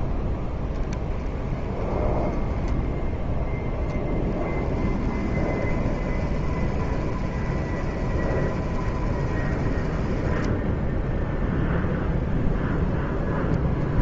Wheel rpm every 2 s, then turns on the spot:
10, 10, 20, 30, 30, 10, 0.
10-12